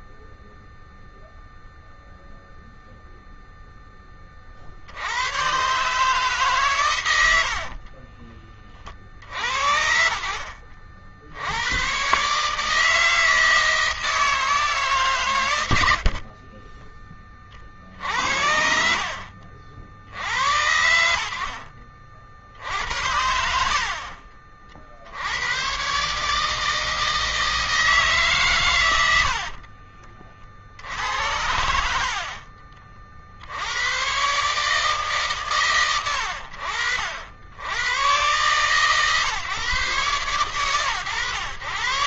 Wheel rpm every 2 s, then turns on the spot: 0, 0, 70, 110, 50, 60, 150, 140, 20, 70, 80, 60, 50, 160, 100, 60, 40, 150, 70, 130, 110.
22-24